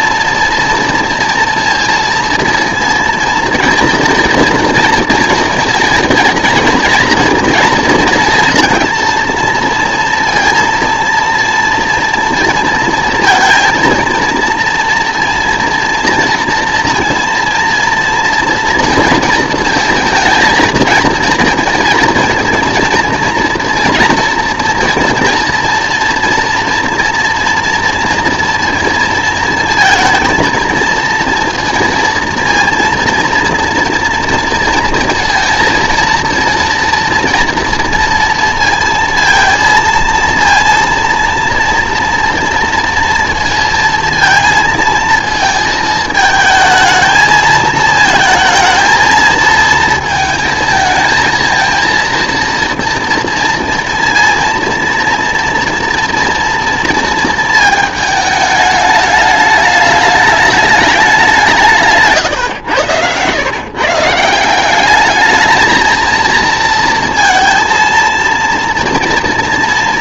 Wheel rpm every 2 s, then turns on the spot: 230, 230, 230, 230, 230, 240, 230, 230, 230, 230, 230, 230, 230, 230, 230, 220, 230, 230, 230, 230, 230, 230, 220, 220, 220, 230, 230, 230, 230, 210, 210, 110, 190, 230, 230.
none